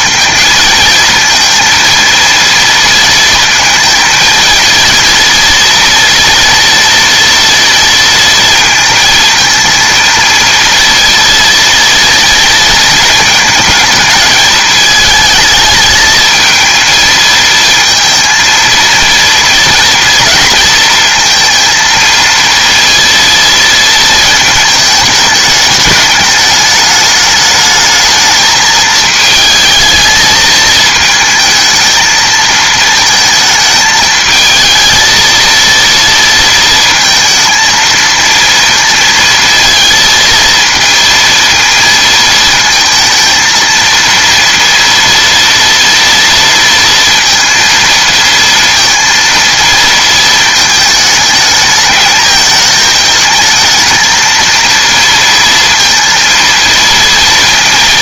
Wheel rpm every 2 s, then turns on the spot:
220, 230, 230, 240, 230, 230, 230, 220, 220, 230, 230, 230, 220, 210, 220, 220, 220, 220, 230, 230, 230, 220, 230, 230, 230, 220, 220, 230, 230.
none